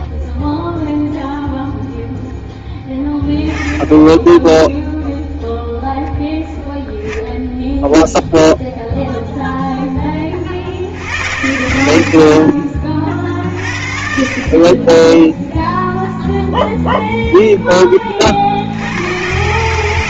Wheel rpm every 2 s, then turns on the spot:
0, 10, 0, 0, 0, 80, 40, 10, 0, 100.
14-16